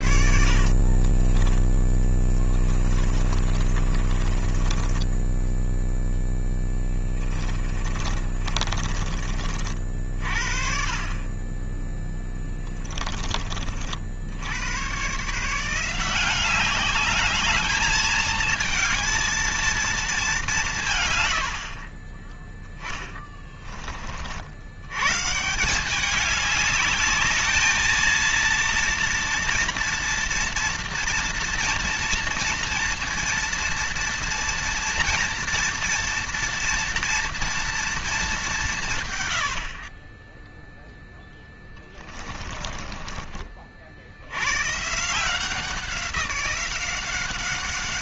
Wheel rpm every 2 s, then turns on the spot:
50, 20, 10, 20, 40, 40, 20, 120, 200, 220, 140, 10, 100, 210, 230, 230, 230, 230, 230, 140, 0, 20, 140, 180.
0-10 12-14 22-24 42-44